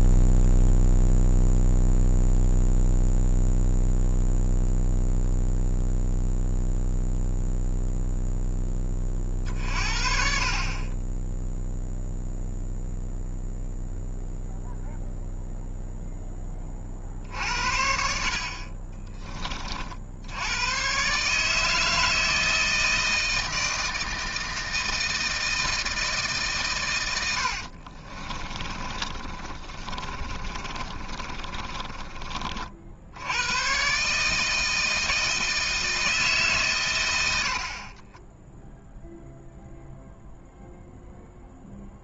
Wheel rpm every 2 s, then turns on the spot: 0, 0, 0, 0, 20, 30, 0, 0, 40, 20, 120, 160, 160, 120, 40, 30, 60, 160, 110, 0, 0.
18-20 28-32